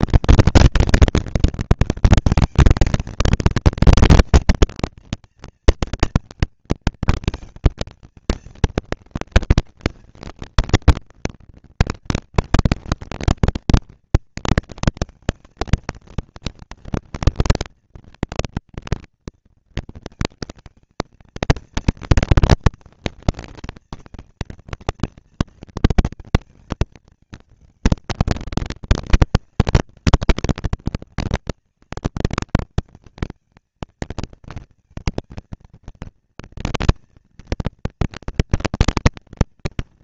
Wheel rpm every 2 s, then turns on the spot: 230, 230, 230, 220, 230, 230, 230, 230, 230, 230, 230, 230, 230, 210, 200, 190, 210, 230, 230, 230.
none